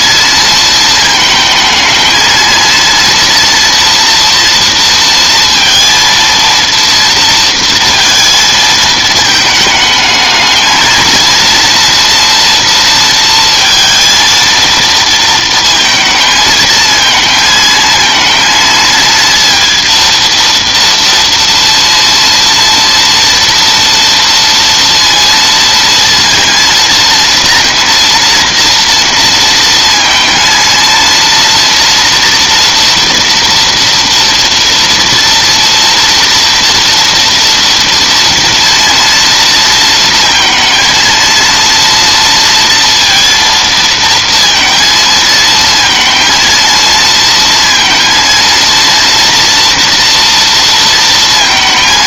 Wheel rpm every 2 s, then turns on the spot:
220, 230, 230, 230, 220, 230, 230, 220, 220, 230, 230, 230, 230, 230, 230, 230, 240, 230, 230, 230, 230, 230, 230, 230, 230, 230.
none